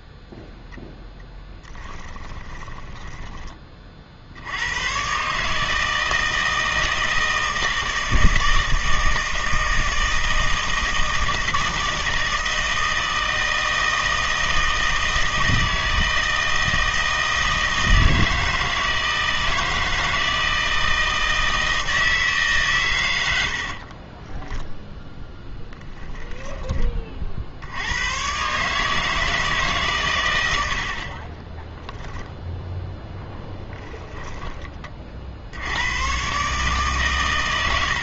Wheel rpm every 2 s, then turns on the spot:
0, 10, 100, 160, 160, 160, 160, 160, 160, 160, 160, 130, 10, 20, 150, 70, 0, 20, 140.
2-4